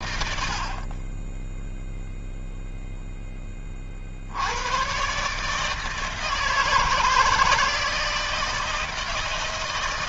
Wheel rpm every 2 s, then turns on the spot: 0, 30, 150, 160, 140.
none